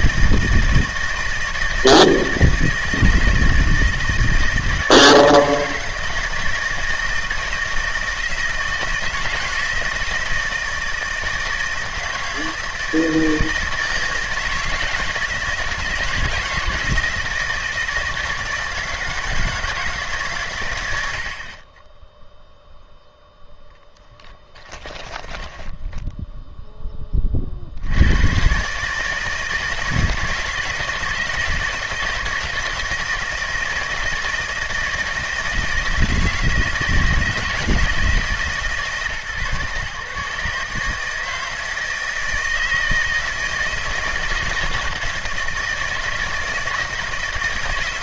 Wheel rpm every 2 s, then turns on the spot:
160, 160, 160, 160, 160, 160, 160, 160, 160, 160, 100, 0, 20, 10, 140, 160, 160, 160, 160, 140, 150, 160, 160, 170.
24-26